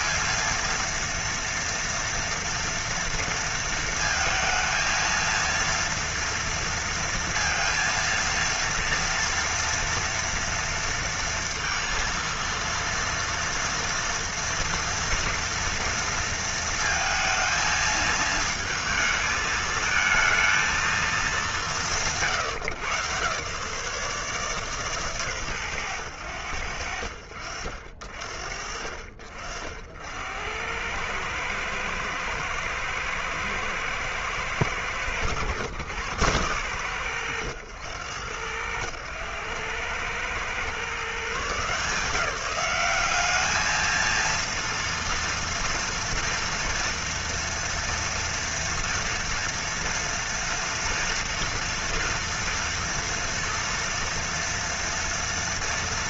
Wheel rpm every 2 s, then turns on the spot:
220, 230, 230, 230, 230, 230, 230, 230, 230, 220, 220, 160, 140, 70, 40, 80, 110, 100, 100, 90, 110, 170, 230, 230, 230, 230, 230, 230.
none